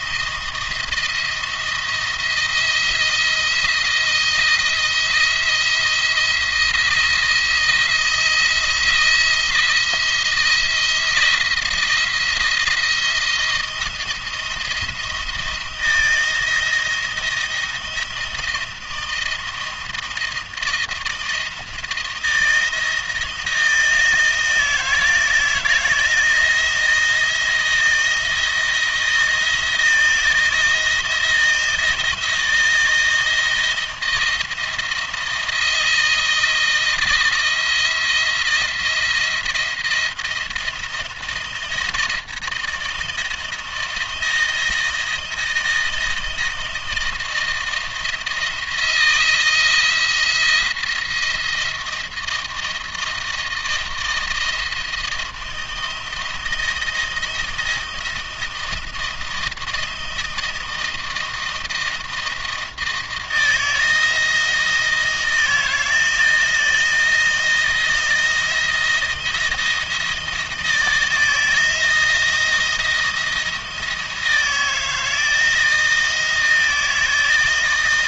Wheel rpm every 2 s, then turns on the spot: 170, 170, 170, 170, 170, 170, 170, 170, 160, 160, 160, 170, 160, 160, 170, 160, 160, 160, 160, 170, 170, 170, 170, 160, 170, 170, 170, 170, 170, 170, 160, 160, 170, 170, 170, 160, 170, 160, 160.
none